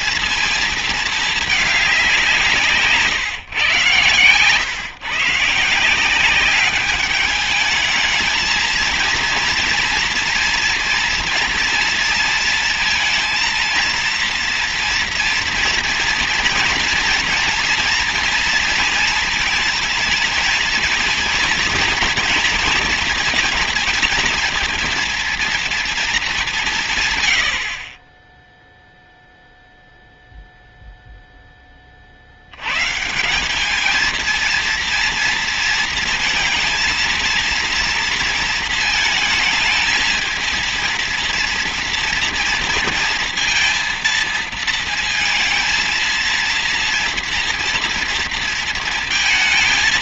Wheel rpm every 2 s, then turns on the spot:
220, 160, 130, 200, 220, 240, 230, 230, 230, 230, 220, 230, 230, 200, 10, 0, 100, 230, 230, 230, 230, 230, 230, 230, 230.
none